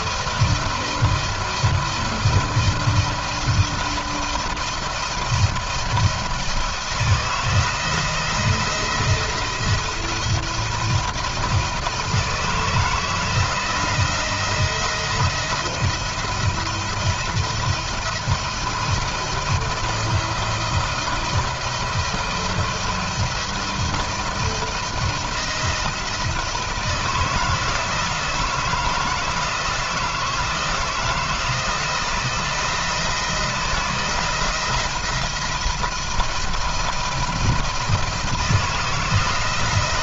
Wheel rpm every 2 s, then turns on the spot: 170, 170, 170, 170, 170, 170, 160, 170, 170, 170, 170, 170, 160, 160, 160, 160, 160, 170, 170, 170.
none